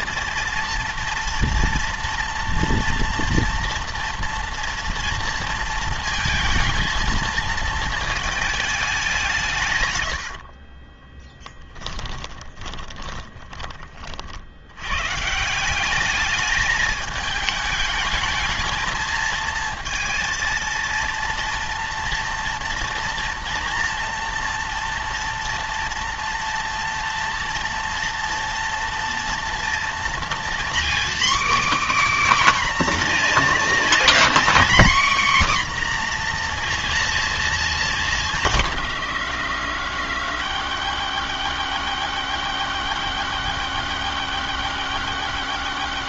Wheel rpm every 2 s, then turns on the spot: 230, 240, 230, 230, 200, 20, 20, 130, 210, 220, 230, 230, 230, 230, 230, 270, 260, 260, 230, 130, 100, 100, 100.
10-14